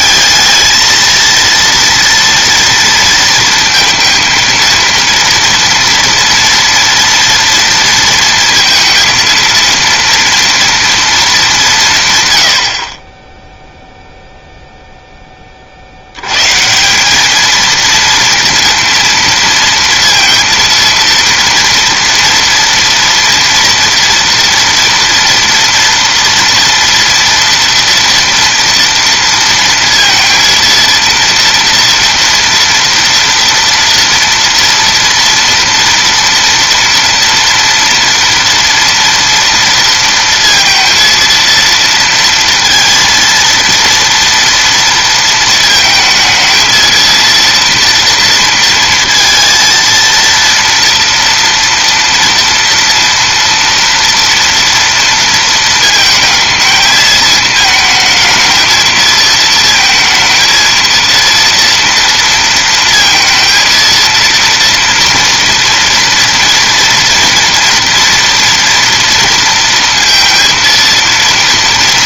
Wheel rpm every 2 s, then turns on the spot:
220, 230, 230, 230, 230, 230, 60, 0, 160, 230, 230, 230, 230, 240, 230, 230, 230, 230, 230, 230, 230, 230, 230, 230, 230, 230, 230, 230, 220, 220, 230, 230, 230, 230, 230, 230.
none